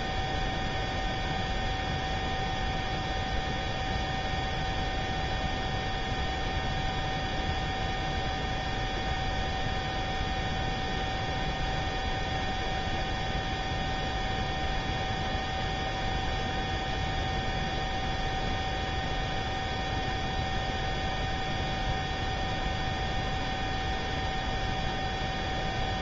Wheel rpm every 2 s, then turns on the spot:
0, 0, 0, 0, 0, 0, 0, 0, 0, 0, 0, 0, 0.
none